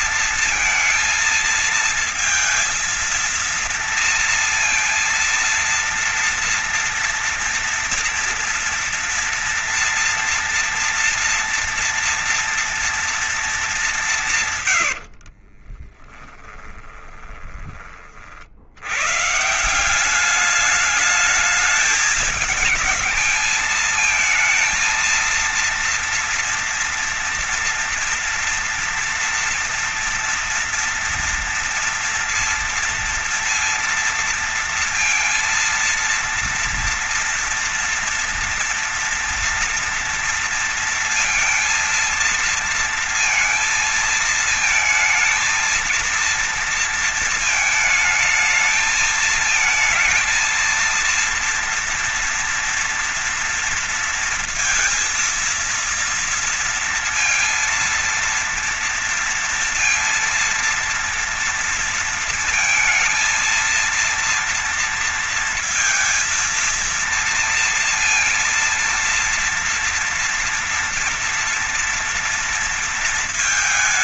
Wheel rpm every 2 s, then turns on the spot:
220, 230, 230, 240, 230, 230, 230, 80, 20, 100, 210, 210, 230, 230, 230, 230, 230, 230, 230, 230, 230, 230, 220, 230, 220, 230, 230, 230, 230, 230, 230, 230, 230, 230, 230, 230, 230.
14-18